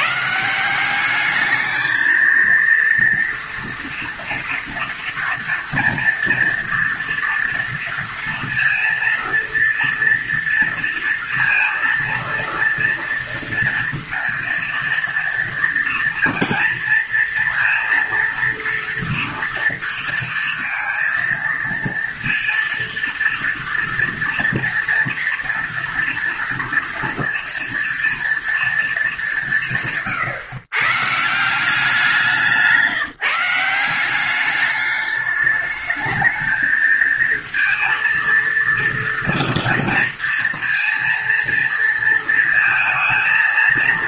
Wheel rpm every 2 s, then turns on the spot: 200, 230, 230, 230, 230, 230, 230, 230, 230, 230, 230, 230, 230, 230, 210, 150, 170, 210, 220, 230, 230, 220.
none